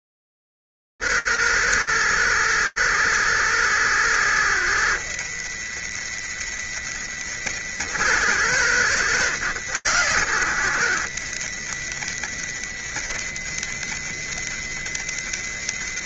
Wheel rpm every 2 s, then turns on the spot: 110, 180, 170, 120, 150, 160, 120, 120.
none